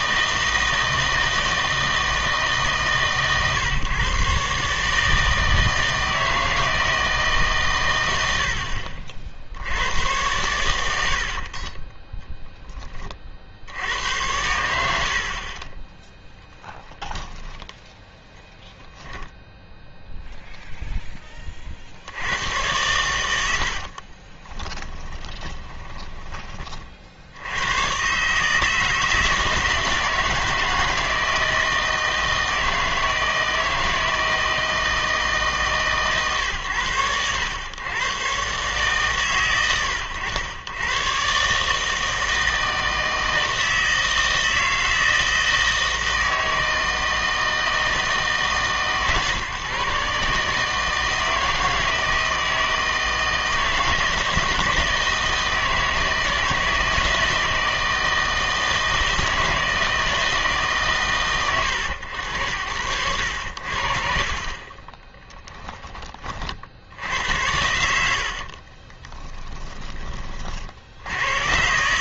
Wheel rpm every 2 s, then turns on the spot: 160, 140, 140, 160, 60, 100, 10, 80, 10, 0, 0, 100, 20, 30, 150, 160, 160, 160, 110, 140, 110, 160, 160, 160, 140, 160, 160, 160, 160, 160, 150, 80, 30, 60, 30, 60.
16-18 24-26 68-70